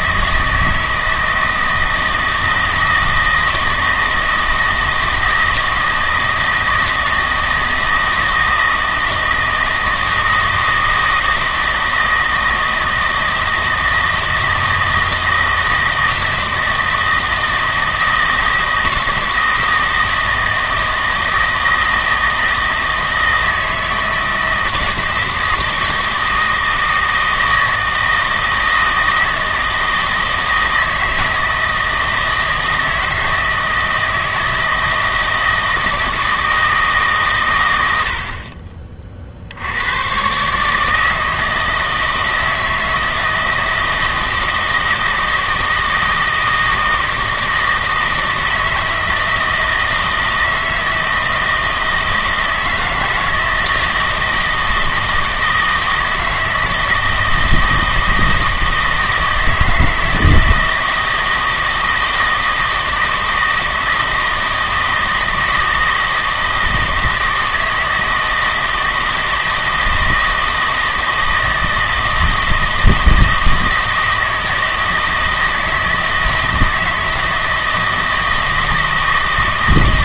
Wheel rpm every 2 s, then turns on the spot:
160, 160, 160, 160, 160, 160, 160, 160, 160, 160, 160, 160, 160, 160, 160, 160, 160, 160, 160, 30, 150, 160, 160, 160, 160, 160, 160, 160, 160, 160, 160, 160, 160, 160, 160, 160, 160, 160, 160, 160.
none